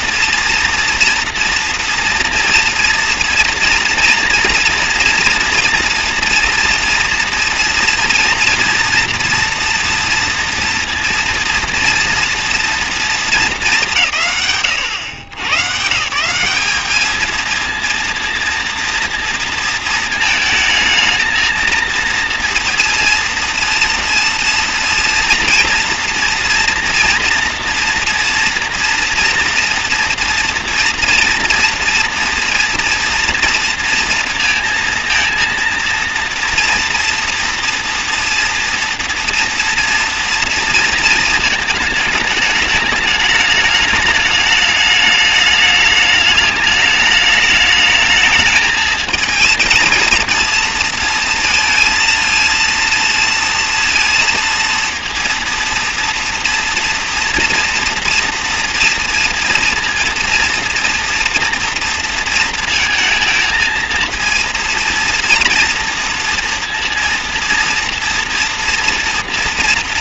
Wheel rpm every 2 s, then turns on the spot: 230, 230, 230, 230, 230, 230, 230, 120, 210, 230, 220, 230, 230, 230, 240, 230, 230, 230, 230, 230, 230, 210, 210, 210, 220, 230, 230, 230, 230, 230, 230, 230, 230, 230, 230.
none